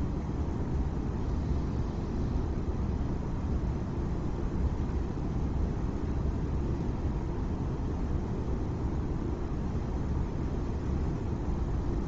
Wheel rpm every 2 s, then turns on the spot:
0, 0, 0, 0, 0, 0.
none